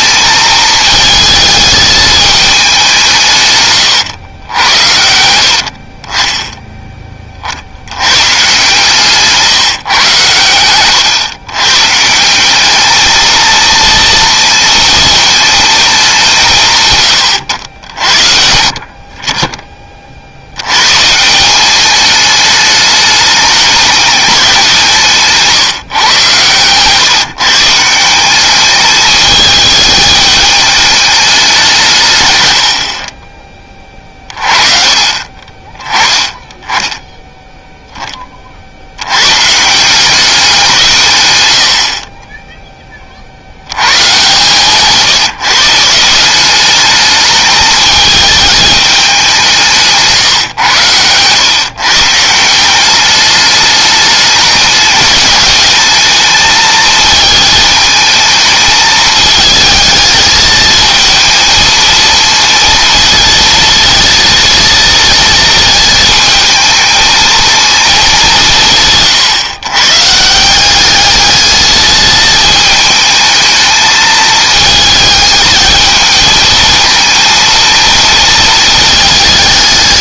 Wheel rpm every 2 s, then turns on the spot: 220, 190, 90, 10, 140, 110, 210, 230, 150, 50, 120, 210, 170, 130, 210, 210, 60, 30, 10, 60, 170, 10, 140, 200, 210, 110, 180, 210, 220, 220, 220, 230, 230, 220, 150, 200, 220, 220, 220, 220.
10-12 32-34